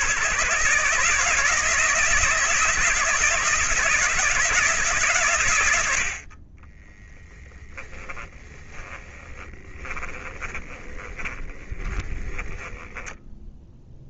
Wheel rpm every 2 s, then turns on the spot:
160, 160, 140, 20, 20, 20, 10.
6-14